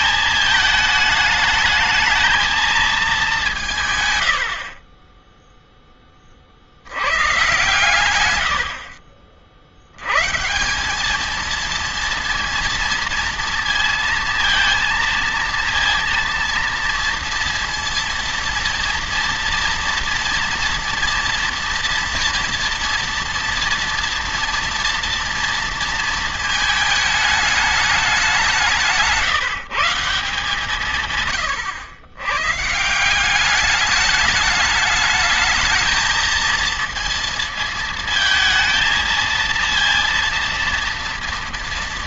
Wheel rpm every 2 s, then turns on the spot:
220, 220, 40, 100, 60, 180, 230, 220, 230, 230, 230, 230, 230, 220, 170, 140, 150, 210, 230, 220, 230.
none